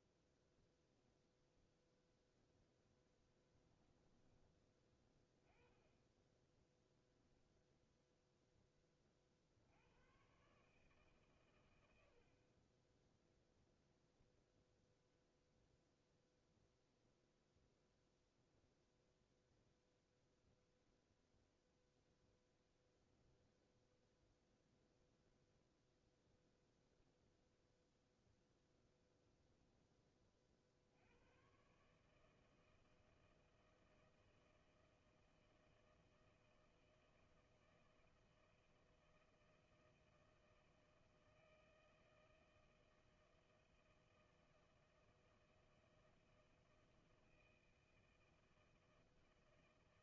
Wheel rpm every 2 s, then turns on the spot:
0, 10, 20, 10, 20, 150, 10, 0, 0, 0, 0, 0, 0, 0, 10, 50, 160, 160, 160, 160, 160, 160, 160, 160, 160.
2-4 12-14